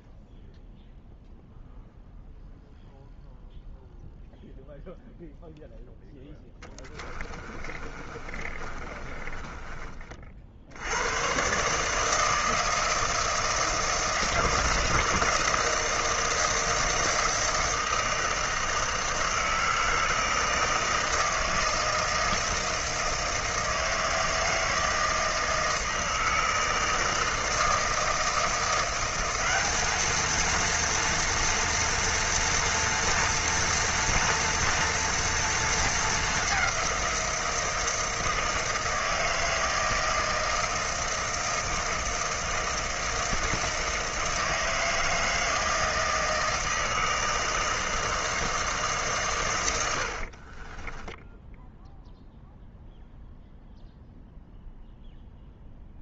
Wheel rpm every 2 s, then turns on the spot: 0, 0, 0, 20, 30, 70, 160, 160, 160, 160, 160, 160, 160, 160, 170, 230, 240, 240, 190, 160, 160, 160, 160, 160, 150, 20, 0, 0.
6-10 50-52